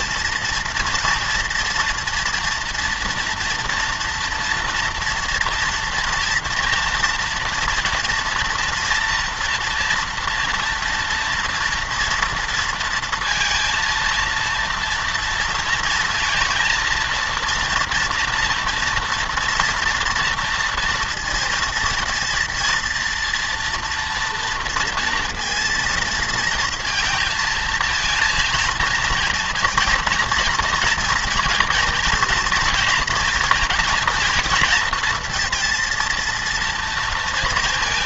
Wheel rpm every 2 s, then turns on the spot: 230, 230, 230, 230, 230, 230, 230, 230, 230, 230, 230, 230, 230, 230, 230, 230, 230, 230, 230.
none